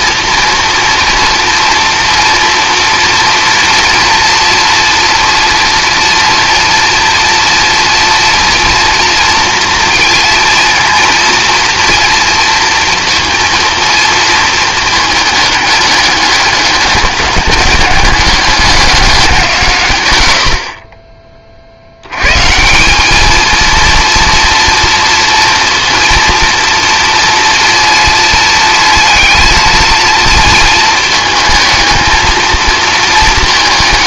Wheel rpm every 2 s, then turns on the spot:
240, 230, 240, 240, 240, 230, 230, 220, 200, 200, 30, 170, 230, 230, 230, 220, 220.
none